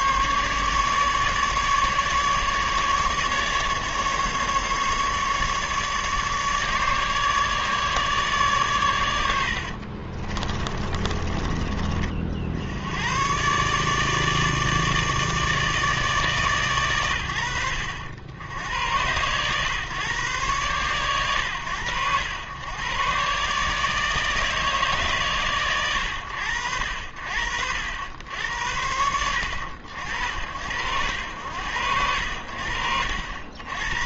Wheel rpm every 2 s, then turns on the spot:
150, 150, 150, 150, 100, 30, 90, 150, 110, 100, 110, 110, 150, 60, 80, 80, 70.
10-12